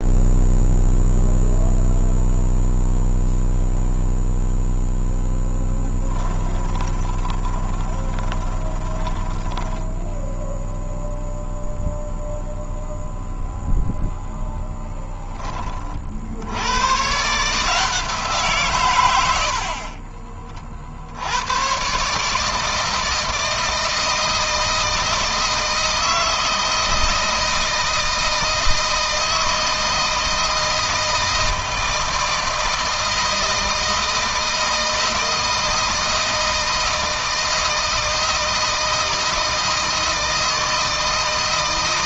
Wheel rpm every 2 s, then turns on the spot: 0, 0, 0, 20, 20, 0, 0, 0, 120, 100, 70, 160, 160, 160, 160, 160, 160, 160, 160, 160, 160.
6-10